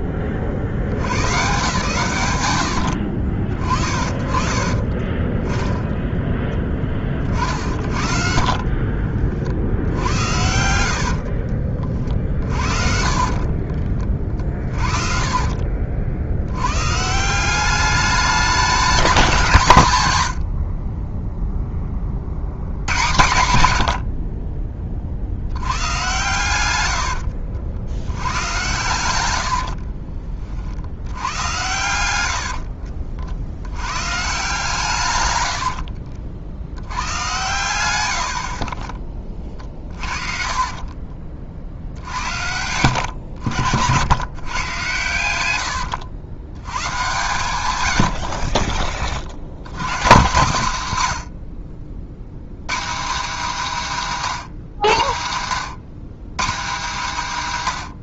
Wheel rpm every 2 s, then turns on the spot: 40, 70, 40, 10, 40, 70, 40, 40, 110, 210, 70, 90, 30, 90, 110, 50, 70, 140, 80, 40, 40, 90, 120, 110, 30, 140, 170, 170, 200.
4-6 8-16 20-22 26-30 32-34 38-42 48-50